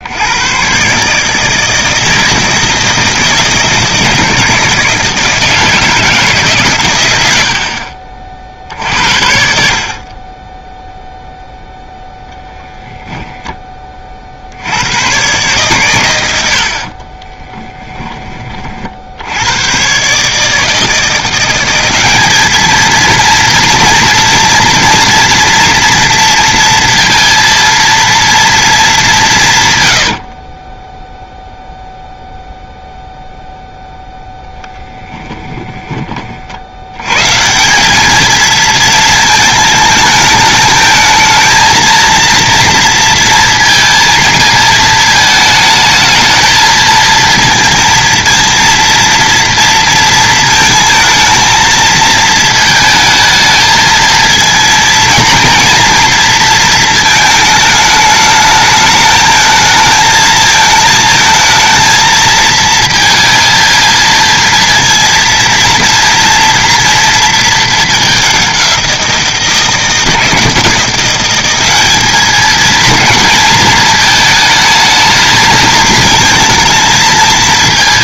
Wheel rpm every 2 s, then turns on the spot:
130, 160, 160, 120, 60, 0, 10, 90, 60, 50, 160, 220, 230, 230, 220, 20, 0, 10, 80, 220, 220, 230, 220, 230, 230, 230, 220, 230, 220, 210, 220, 220, 230, 230, 180, 170, 220, 220, 220.
12-14 16-18 34-36